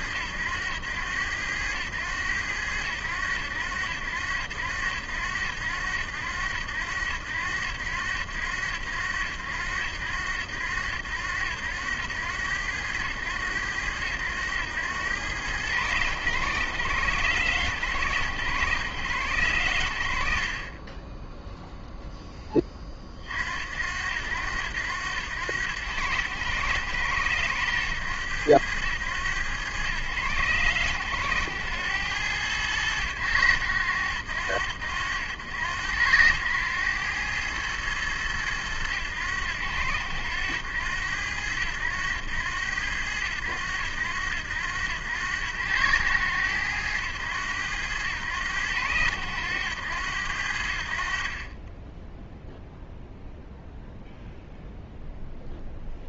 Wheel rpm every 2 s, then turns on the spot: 90, 100, 80, 90, 90, 70, 90, 90, 100, 100, 40, 20, 80, 90, 100, 110, 100, 70, 90, 100, 80, 90, 90, 100, 100, 70, 0, 0.
none